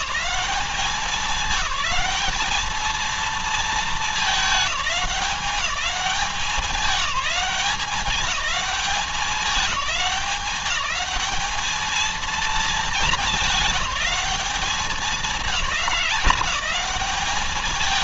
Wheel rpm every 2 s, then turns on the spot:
200, 210, 210, 190, 190, 200, 220, 210, 210.
none